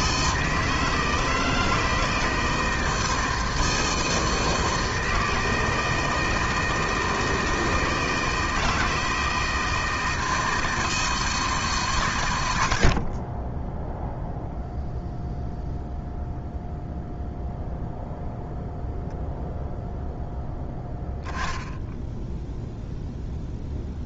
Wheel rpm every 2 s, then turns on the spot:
160, 160, 160, 160, 160, 160, 80, 0, 0, 0, 10, 0.
none